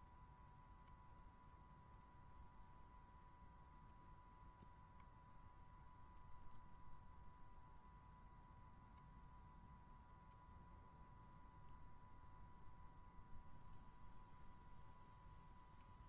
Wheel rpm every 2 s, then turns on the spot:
120, 120, 120, 120, 120, 120, 120, 120.
none